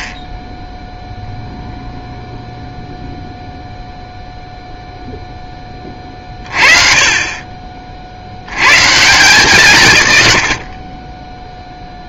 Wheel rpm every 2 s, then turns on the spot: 0, 0, 0, 30, 130, 50.
none